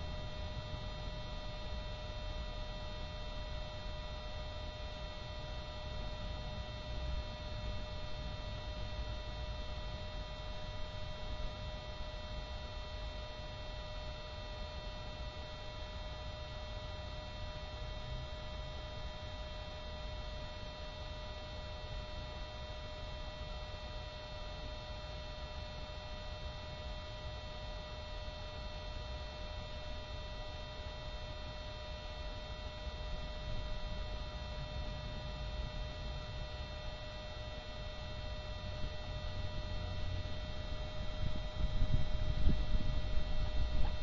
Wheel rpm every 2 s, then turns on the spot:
0, 0, 0, 0, 0, 0, 0, 0, 0, 0, 0, 0, 0, 0, 0, 0, 0, 0, 0, 0, 0, 0.
none